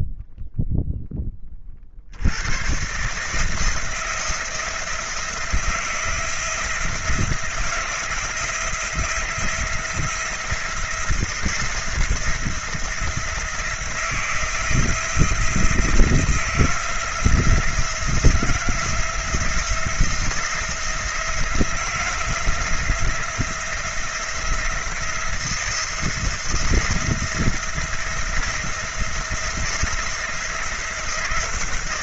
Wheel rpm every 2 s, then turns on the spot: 0, 110, 170, 170, 170, 170, 170, 170, 170, 170, 170, 170, 170, 170, 170, 170.
none